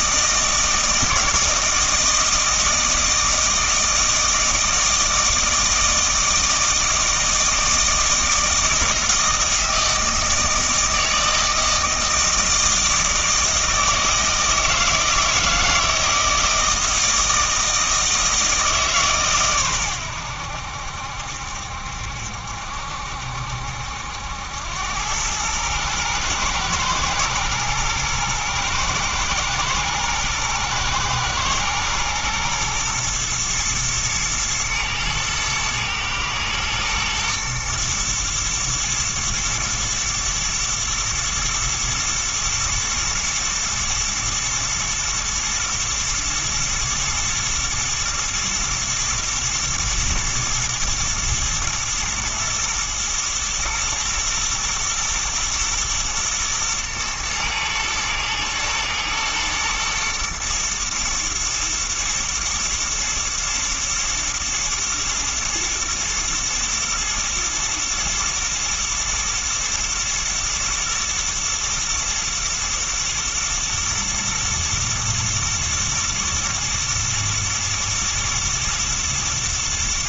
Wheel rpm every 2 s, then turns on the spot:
160, 160, 160, 160, 160, 160, 160, 160, 160, 150, 80, 70, 90, 120, 120, 110, 120, 120, 120, 120, 110, 120, 110, 120, 120, 110, 110, 110, 110, 110, 120, 120, 110, 110, 120, 120, 120, 120, 110, 120.
none